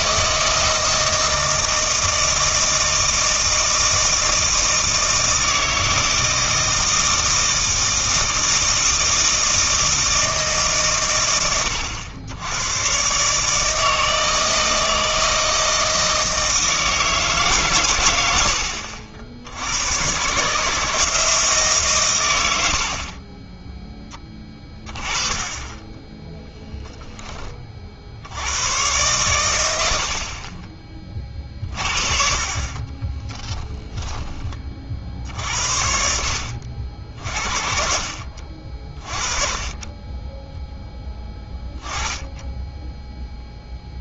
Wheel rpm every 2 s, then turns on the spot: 160, 160, 160, 160, 160, 140, 110, 160, 160, 60, 160, 70, 20, 10, 110, 30, 30, 50, 70, 40, 10, 0.
32-34